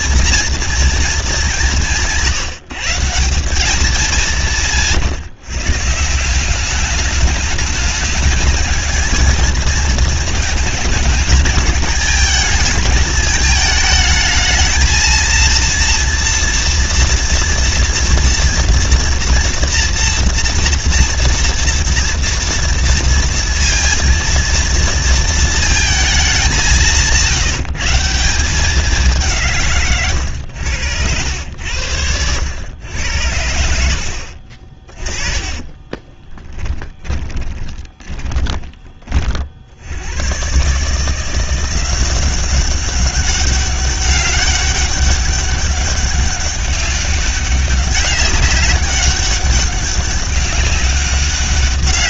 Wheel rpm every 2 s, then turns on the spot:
220, 170, 150, 210, 220, 210, 220, 220, 230, 230, 230, 230, 230, 170, 190, 90, 90, 30, 20, 30, 150, 200, 200, 200, 200, 190.
34-38